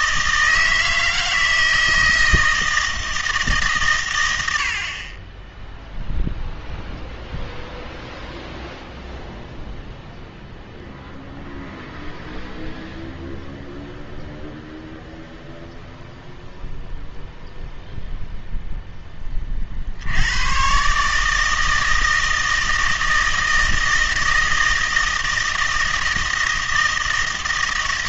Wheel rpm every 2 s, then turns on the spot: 160, 160, 70, 0, 0, 0, 0, 0, 0, 0, 120, 160, 160, 160.
none